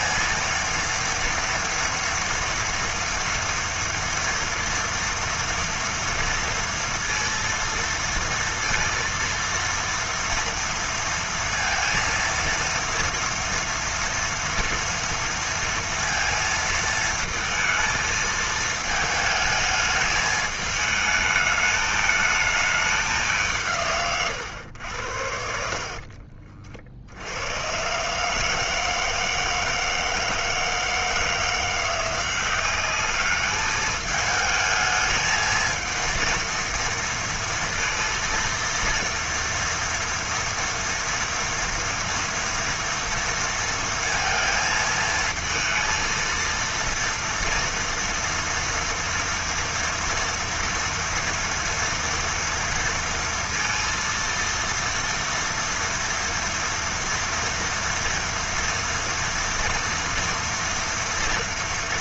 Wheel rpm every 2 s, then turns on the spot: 230, 230, 230, 230, 230, 230, 230, 230, 230, 220, 210, 220, 120, 40, 150, 160, 180, 220, 230, 230, 240, 230, 230, 230, 230, 230, 230, 230, 240, 230, 230.
none